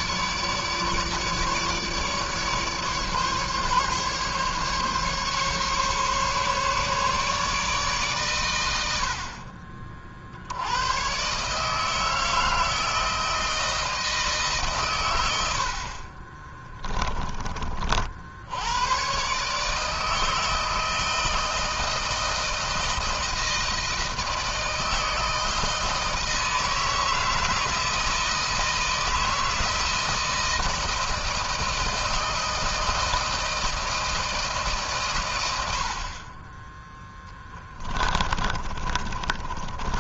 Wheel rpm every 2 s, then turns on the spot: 150, 140, 140, 140, 80, 100, 160, 120, 20, 110, 160, 160, 160, 160, 160, 160, 160, 140, 10, 30.
38-40